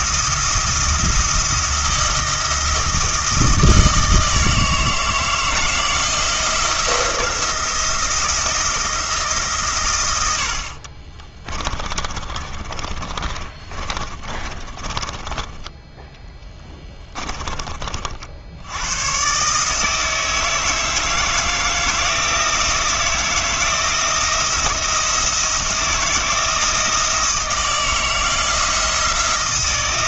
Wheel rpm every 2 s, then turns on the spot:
170, 160, 160, 170, 170, 50, 30, 30, 10, 90, 160, 160, 170, 160, 170.
10-18